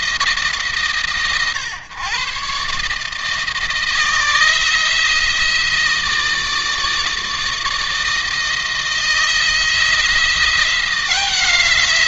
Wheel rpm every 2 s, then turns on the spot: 150, 140, 160, 160, 160, 170.
none